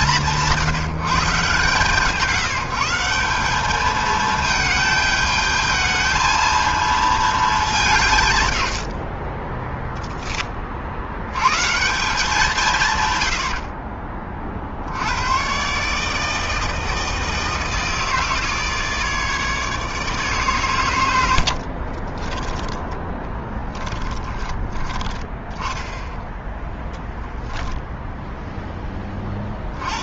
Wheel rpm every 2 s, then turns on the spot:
140, 200, 210, 210, 30, 90, 70, 120, 160, 150, 70, 10, 10, 0, 40.
12-14 20-24